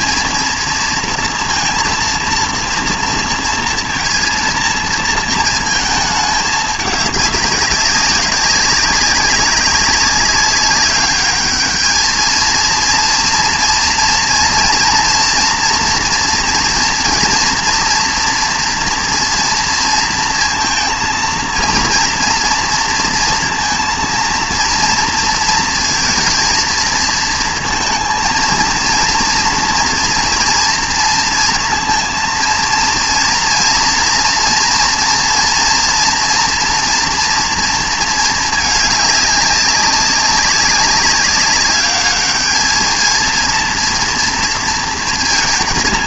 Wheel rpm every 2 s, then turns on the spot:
230, 230, 230, 210, 190, 200, 230, 230, 230, 230, 230, 230, 230, 230, 230, 230, 230, 230, 230, 220, 200, 210, 230.
none